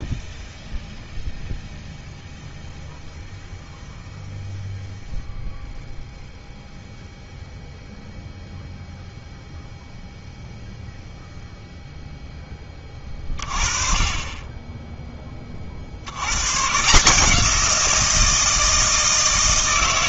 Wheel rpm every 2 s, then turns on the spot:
0, 0, 0, 0, 0, 0, 20, 10, 120, 170.
none